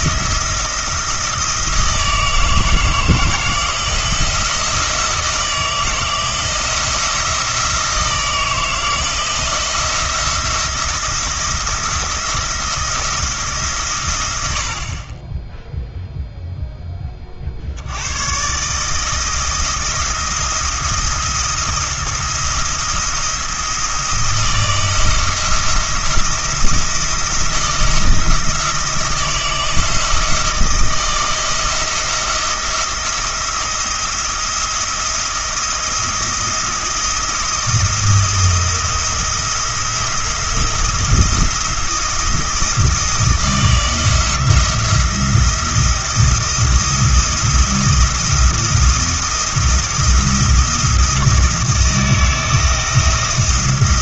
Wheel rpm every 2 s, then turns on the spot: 170, 160, 170, 170, 160, 170, 170, 50, 10, 150, 170, 170, 170, 170, 170, 170, 170, 170, 170, 170, 170, 170, 170, 170, 170, 170, 160.
none